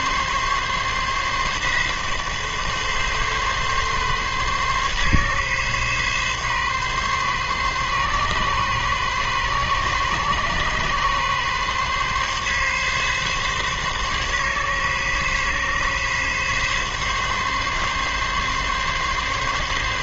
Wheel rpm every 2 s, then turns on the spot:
140, 140, 140, 140, 130, 130, 140, 140, 140, 140.
none